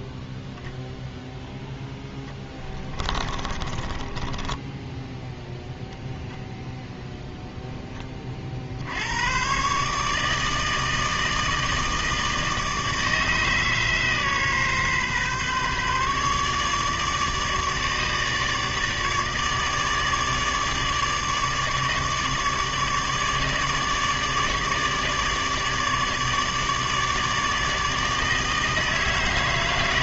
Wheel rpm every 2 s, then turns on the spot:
0, 20, 10, 0, 50, 160, 160, 140, 150, 150, 150, 150, 150, 150, 160.
2-6